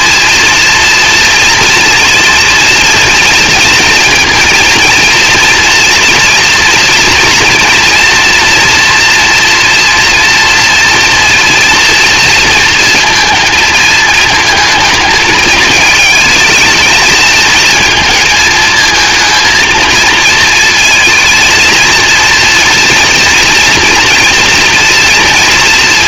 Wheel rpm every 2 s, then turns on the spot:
230, 230, 230, 240, 230, 230, 230, 220, 220, 220, 220, 230, 230.
none